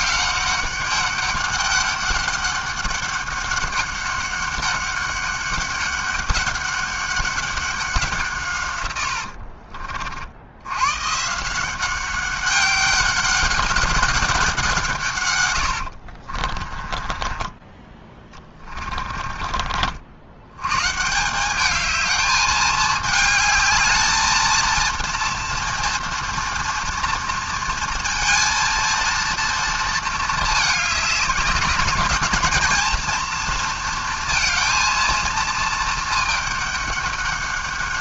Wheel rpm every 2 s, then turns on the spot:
200, 200, 200, 200, 150, 60, 190, 190, 50, 20, 100, 210, 220, 240, 230, 220, 230, 230, 210.
16-20